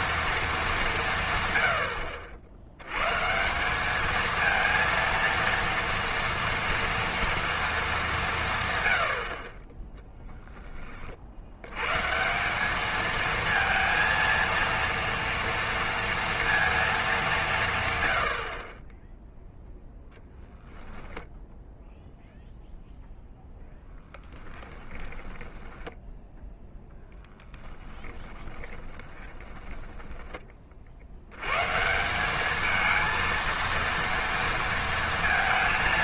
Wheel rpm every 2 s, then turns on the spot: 200, 80, 230, 230, 130, 10, 200, 230, 230, 40, 10, 0, 10, 0, 20, 30, 210, 230.
24-26 28-30